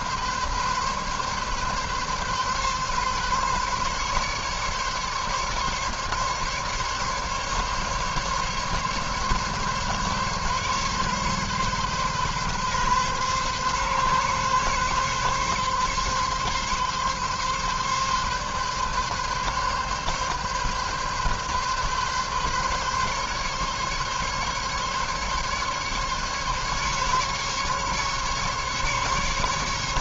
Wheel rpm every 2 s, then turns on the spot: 140, 140, 140, 140, 140, 140, 130, 140, 130, 140, 140, 140, 140, 140, 140.
none